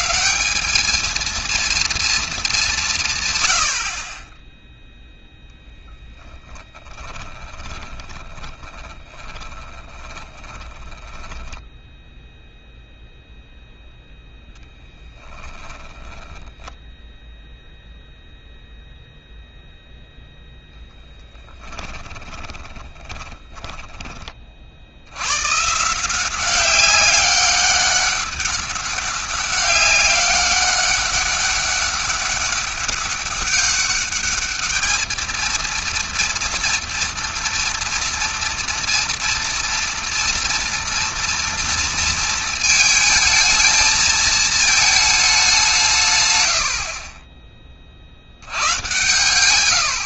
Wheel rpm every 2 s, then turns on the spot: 190, 200, 10, 10, 20, 20, 0, 10, 10, 0, 0, 10, 60, 190, 200, 200, 200, 210, 230, 230, 230, 220, 220, 70, 110.
6-12 22-24